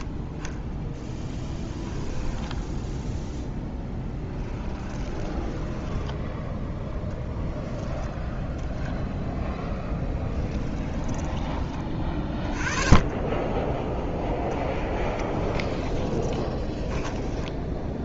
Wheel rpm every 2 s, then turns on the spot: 30, 0, 10, 0, 0, 10, 20, 10, 20.
4-6 10-12 14-18